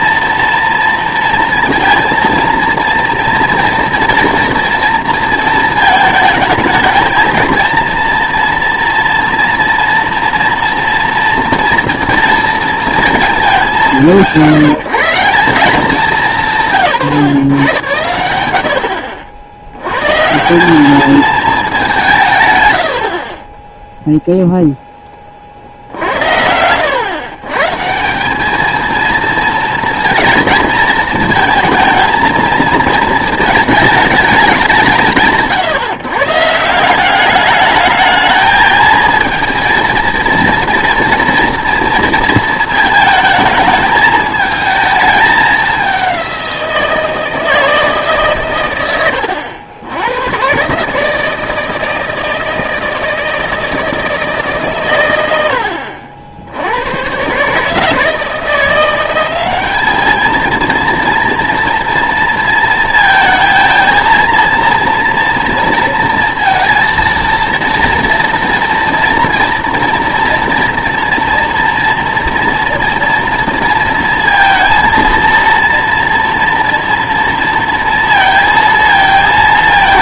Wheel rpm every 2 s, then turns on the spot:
230, 230, 230, 220, 240, 240, 230, 150, 150, 70, 190, 90, 10, 90, 220, 220, 220, 180, 170, 220, 230, 220, 220, 180, 120, 140, 160, 130, 90, 170, 230, 230, 230, 230, 240, 230, 230, 230, 230, 230.
18-20